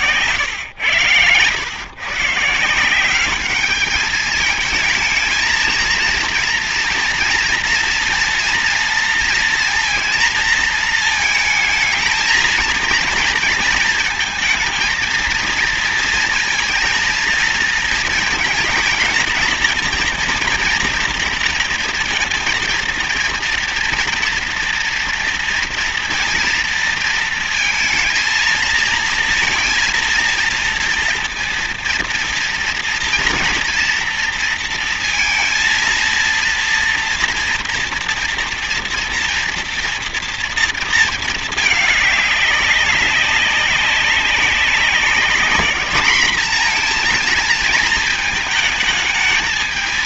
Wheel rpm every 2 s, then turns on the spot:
100, 170, 220, 240, 230, 220, 230, 230, 230, 230, 230, 230, 230, 230, 230, 230, 230, 230, 230, 230, 230, 200, 200, 230, 220.
none